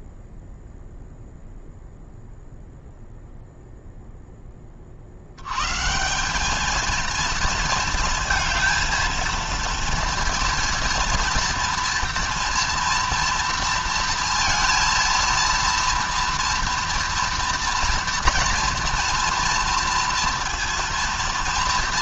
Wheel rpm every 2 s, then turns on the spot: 0, 0, 30, 220, 230, 230, 230, 230, 230, 230, 230.
none